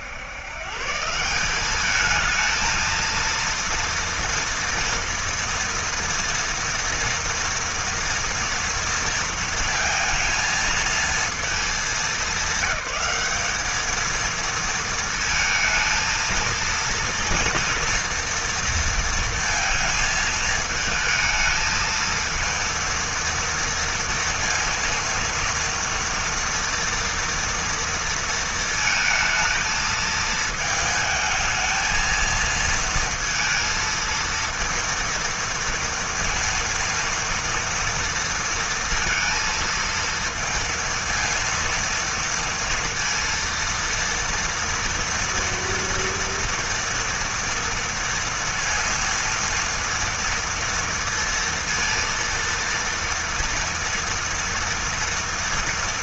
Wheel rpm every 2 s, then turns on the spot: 120, 220, 230, 230, 230, 230, 200, 230, 230, 230, 220, 230, 230, 230, 230, 220, 230, 230, 230, 230, 230, 230, 230, 230, 230, 230, 230, 230.
none